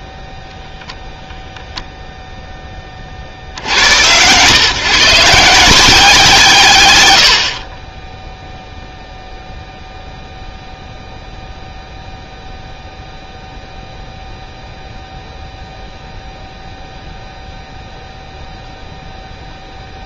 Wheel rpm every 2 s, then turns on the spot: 0, 10, 140, 150, 0, 0, 0, 0, 0, 0.
none